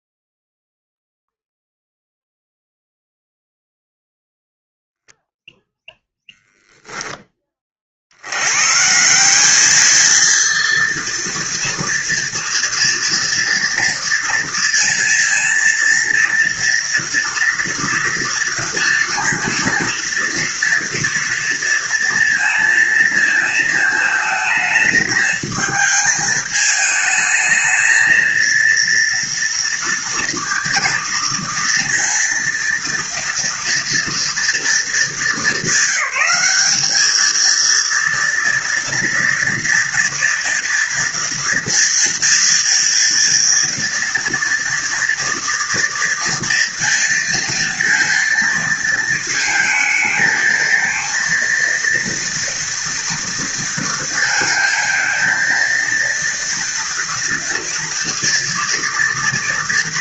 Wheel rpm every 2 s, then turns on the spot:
0, 0, 0, 10, 190, 230, 230, 230, 230, 230, 230, 230, 220, 220, 230, 230, 230, 210, 220, 230, 230, 230, 230, 230, 230, 230, 230, 230, 230, 230.
none